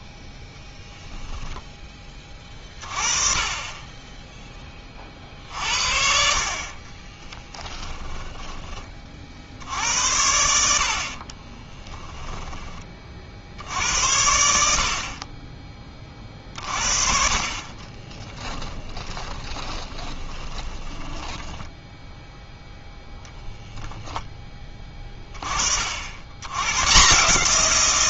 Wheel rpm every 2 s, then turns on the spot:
10, 30, 30, 40, 20, 80, 20, 60, 50, 20, 20, 0, 20, 130.
6-8 18-22